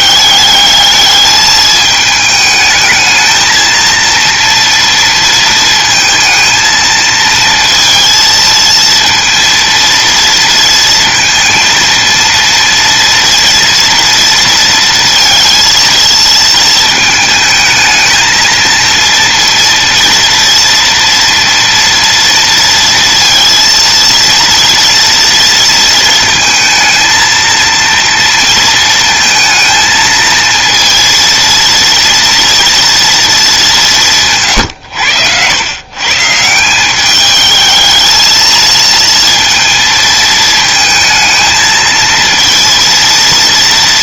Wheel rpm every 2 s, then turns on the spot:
210, 220, 230, 220, 230, 230, 240, 230, 220, 230, 230, 230, 230, 230, 230, 230, 230, 100, 190, 230, 220, 230.
none